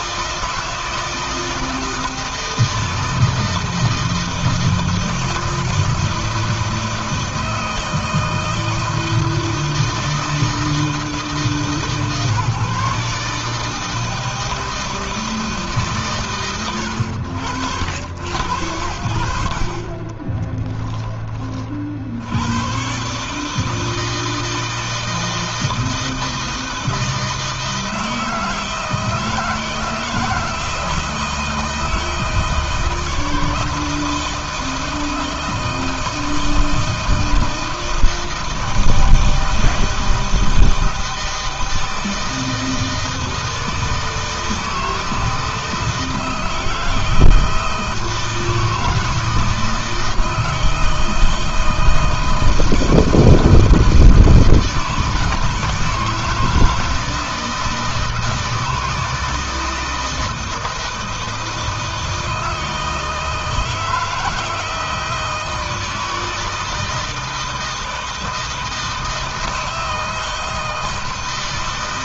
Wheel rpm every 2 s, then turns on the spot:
160, 160, 160, 160, 160, 160, 150, 160, 120, 90, 10, 100, 160, 160, 160, 160, 160, 160, 160, 160, 160, 160, 160, 160, 160, 160, 160, 160, 160, 160, 160, 160, 160, 160, 160, 160.
20-22